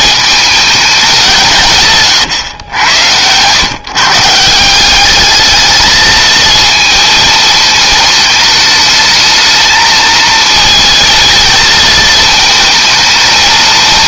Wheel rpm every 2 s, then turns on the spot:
210, 100, 180, 230, 220, 220, 220.
none